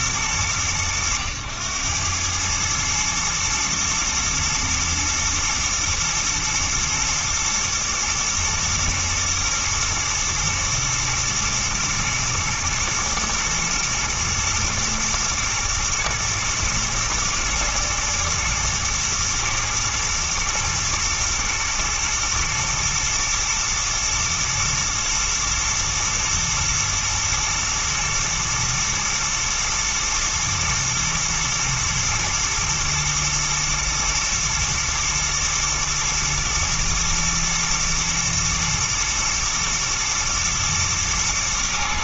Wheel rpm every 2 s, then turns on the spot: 100, 110, 110, 110, 120, 120, 120, 120, 110, 120, 120, 110, 120, 120, 110, 110, 110, 120, 110, 110, 110.
none